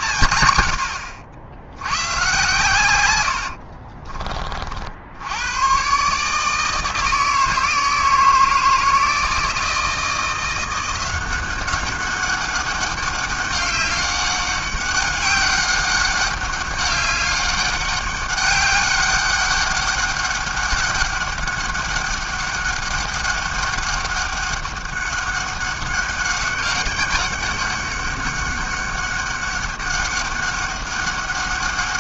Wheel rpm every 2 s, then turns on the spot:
100, 120, 50, 160, 160, 170, 200, 200, 200, 200, 200, 200, 200, 200, 200, 200.
none